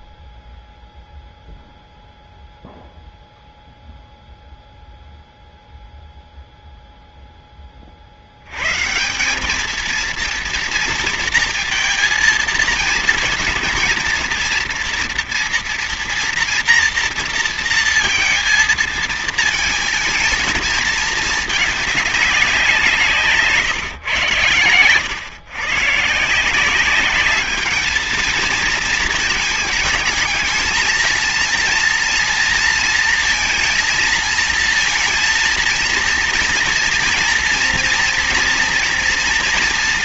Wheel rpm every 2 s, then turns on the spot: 0, 0, 0, 0, 150, 230, 230, 230, 230, 220, 220, 170, 120, 190, 220, 220, 230, 230, 230, 230.
none